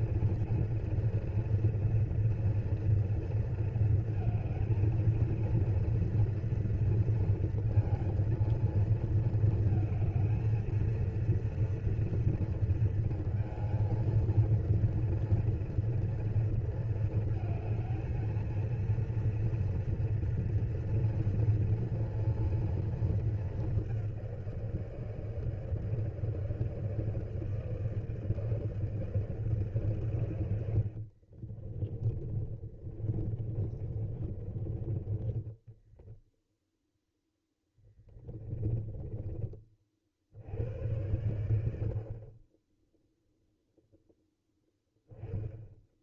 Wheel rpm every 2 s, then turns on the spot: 230, 230, 220, 230, 220, 230, 230, 230, 230, 230, 230, 230, 170, 160, 150, 60, 40, 40, 0, 20, 80, 20, 10.
32-36 38-40